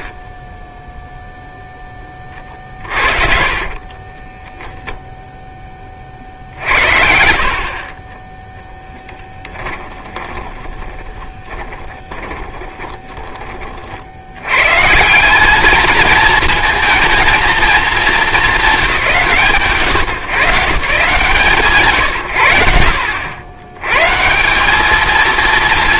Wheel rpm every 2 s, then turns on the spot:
30, 40, 0, 60, 10, 20, 20, 100, 220, 200, 130, 90, 170.
10-14